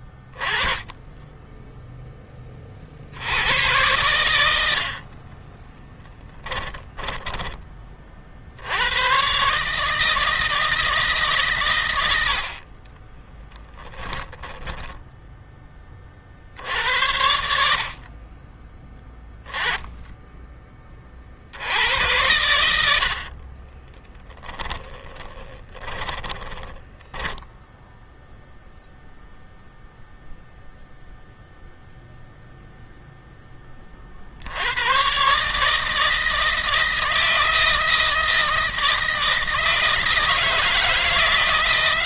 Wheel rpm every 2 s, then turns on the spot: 10, 70, 60, 10, 110, 150, 30, 10, 70, 10, 30, 60, 20, 20, 0, 0, 0, 120, 160, 160, 160.
6-8 12-16 24-28